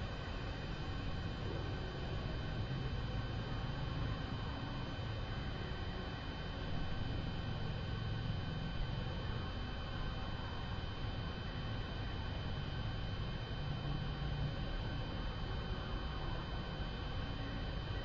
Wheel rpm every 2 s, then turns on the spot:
0, 0, 0, 0, 0, 0, 0, 0, 0.
none